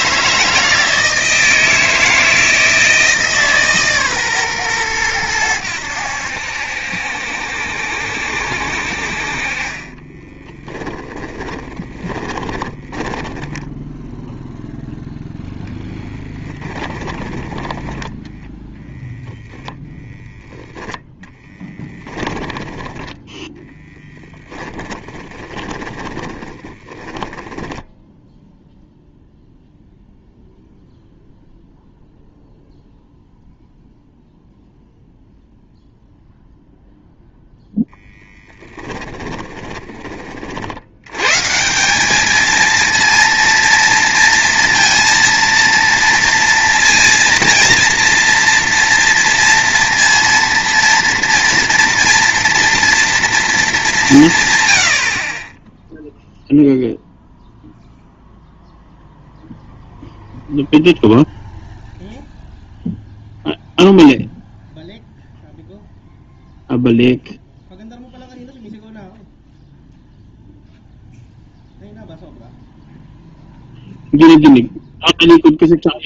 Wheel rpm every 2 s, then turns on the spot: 160, 160, 120, 70, 60, 10, 20, 0, 20, 10, 10, 10, 10, 20, 0, 0, 0, 0, 0, 10, 60, 220, 230, 230, 230, 230, 230, 120, 0, 0, 0, 0, 0, 0, 0, 0, 0, 0.
10-14 16-18 22-28 38-40